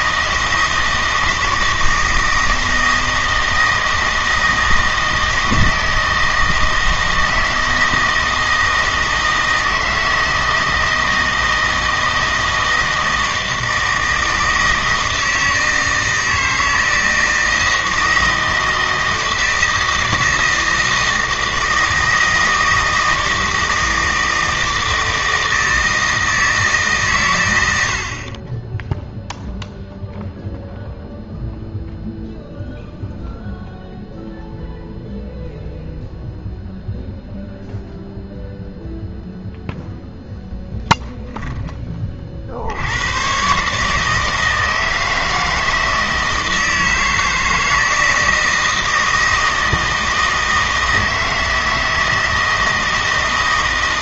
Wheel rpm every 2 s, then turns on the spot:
160, 160, 160, 160, 160, 160, 160, 160, 160, 160, 160, 160, 160, 150, 10, 0, 0, 0, 0, 0, 10, 80, 160, 160, 160, 160, 160.
28-30